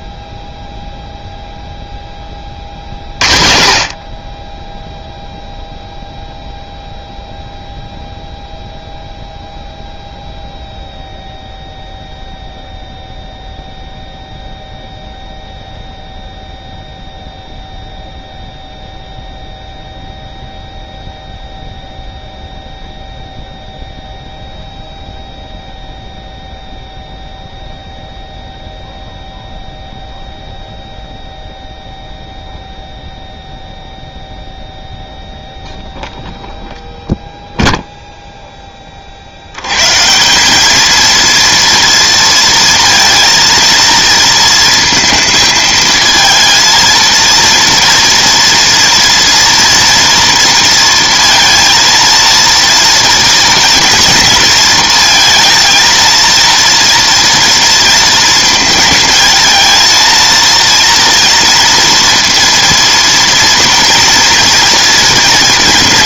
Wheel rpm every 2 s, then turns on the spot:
0, 40, 20, 0, 0, 0, 0, 0, 0, 0, 0, 0, 0, 0, 0, 0, 0, 0, 0, 10, 210, 230, 230, 230, 230, 230, 230, 230, 230, 230, 230, 230, 230.
none